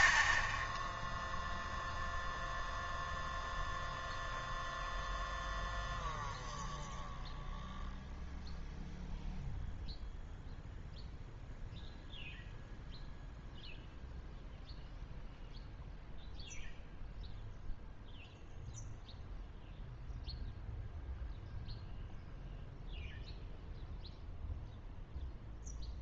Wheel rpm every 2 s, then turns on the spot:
0, 0, 0, 0, 0, 0, 0, 0, 0, 0, 0, 0, 0.
none